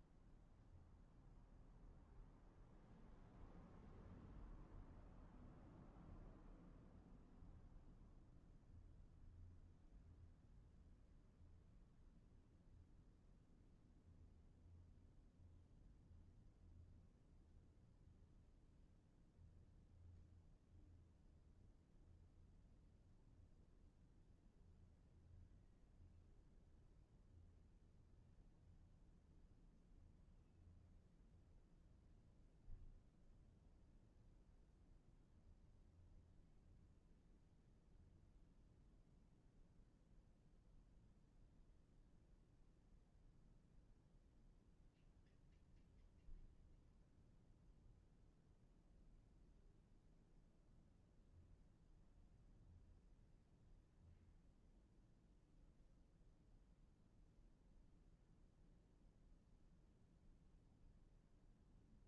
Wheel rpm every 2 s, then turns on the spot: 0, 0, 0, 0, 0, 0, 0, 0, 0, 0, 0, 0, 0, 0, 0, 0, 0, 0, 0, 0, 0, 0, 0, 0, 0, 0, 0, 0, 0, 0, 0.
none